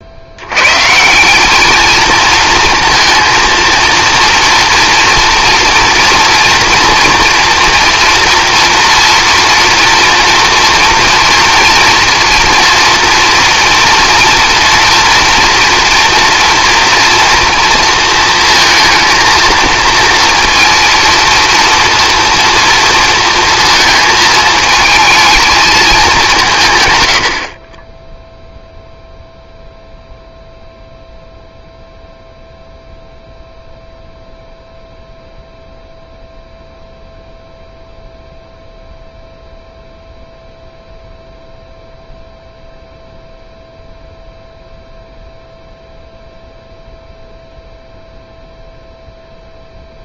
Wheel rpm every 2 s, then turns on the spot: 120, 230, 230, 230, 230, 230, 230, 230, 230, 230, 230, 230, 220, 130, 0, 0, 0, 0, 0, 0, 0, 0, 0, 0, 0.
none